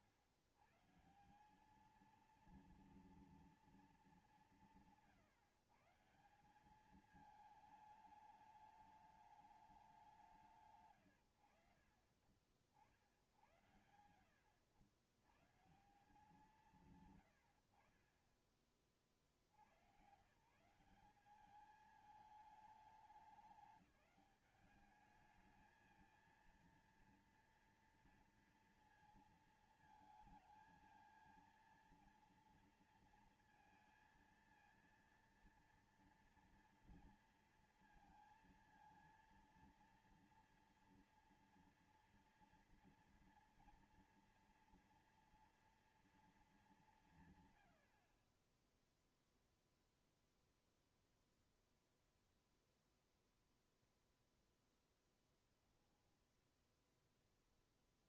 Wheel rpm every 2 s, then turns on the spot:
100, 230, 200, 190, 210, 160, 50, 90, 160, 30, 160, 210, 200, 230, 230, 220, 230, 230, 230, 230, 230, 230, 240, 210, 30, 0, 0, 0, 0.
none